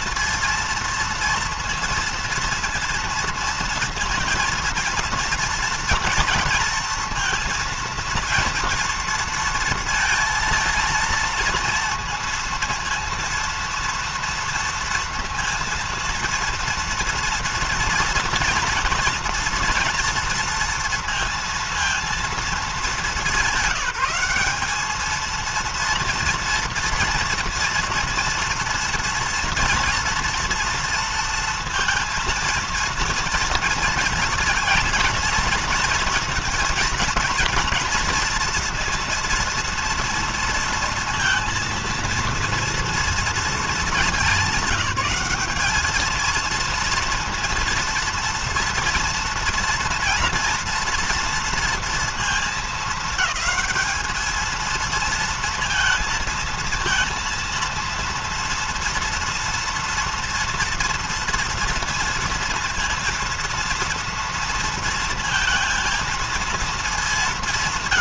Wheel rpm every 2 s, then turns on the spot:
230, 230, 230, 230, 230, 230, 230, 230, 230, 230, 230, 210, 190, 230, 230, 240, 230, 230, 230, 230, 230, 230, 200, 220, 230, 230, 220, 220, 230, 230, 230, 230, 230, 220.
none